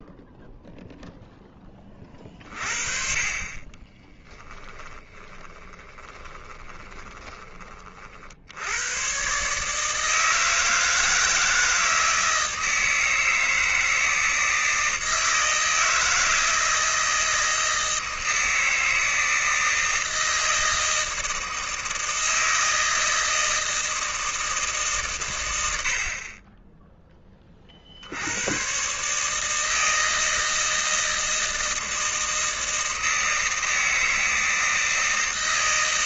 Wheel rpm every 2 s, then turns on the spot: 0, 40, 10, 30, 100, 160, 160, 160, 160, 160, 160, 160, 150, 20, 120, 160, 160, 160.
4-8